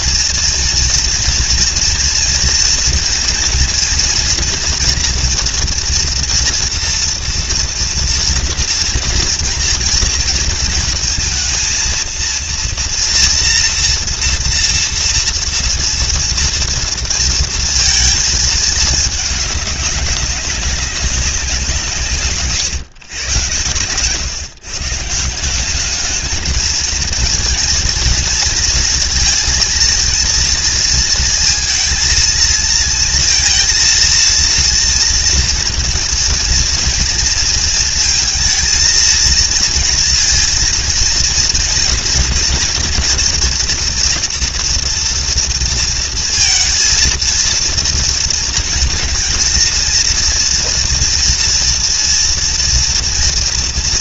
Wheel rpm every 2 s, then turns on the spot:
230, 230, 230, 230, 230, 230, 230, 240, 230, 220, 200, 130, 150, 220, 230, 230, 230, 230, 240, 220, 230, 230, 230, 230, 230, 230, 230.
none